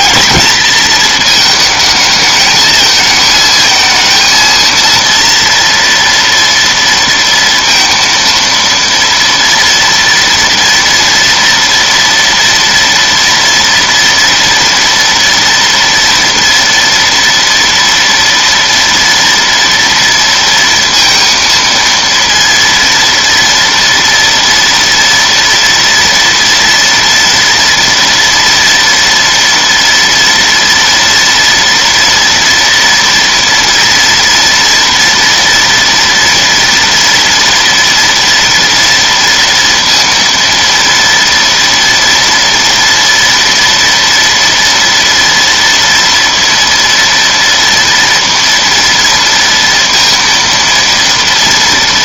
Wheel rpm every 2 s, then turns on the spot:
220, 220, 230, 230, 230, 230, 230, 230, 240, 230, 230, 230, 230, 230, 230, 240, 230, 230, 230, 230, 230, 240, 230, 230, 230, 230.
none